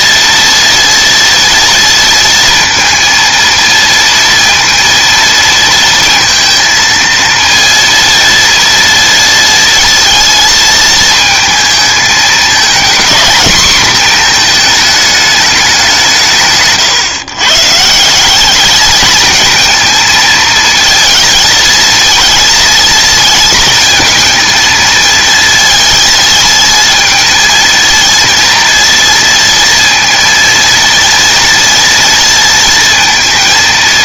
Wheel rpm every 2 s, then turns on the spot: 230, 230, 230, 230, 230, 230, 220, 220, 150, 200, 230, 230, 230, 220, 230, 230, 230.
none